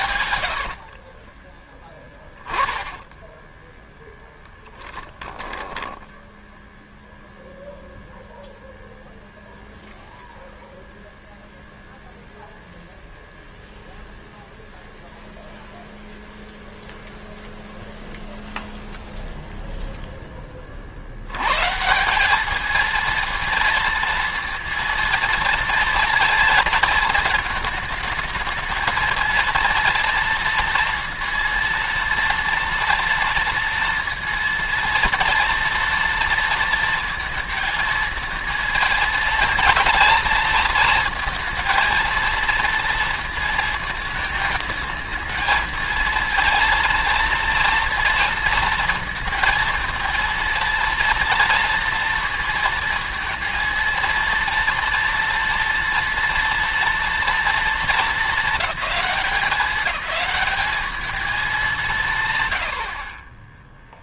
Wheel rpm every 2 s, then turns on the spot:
50, 20, 10, 0, 0, 0, 0, 0, 0, 0, 40, 210, 230, 220, 220, 230, 230, 230, 230, 220, 220, 230, 220, 230, 230, 230, 230, 230, 230, 210, 210, 60.
0-2 4-6